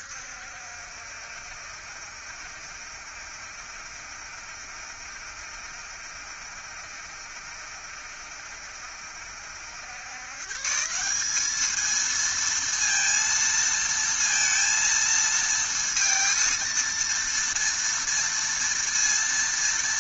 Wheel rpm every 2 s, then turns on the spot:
70, 70, 70, 70, 70, 150, 230, 230, 230, 230.
none